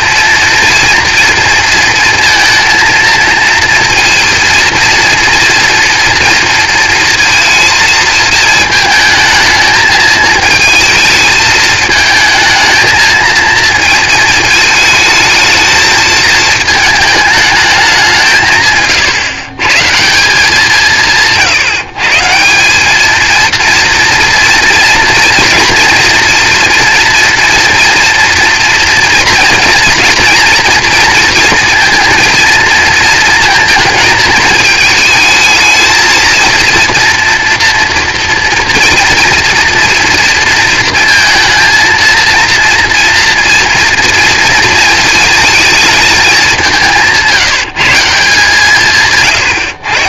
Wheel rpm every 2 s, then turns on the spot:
230, 230, 230, 230, 220, 220, 220, 220, 220, 140, 180, 200, 230, 230, 230, 220, 230, 220, 230, 230, 230, 230, 230, 190, 150.
none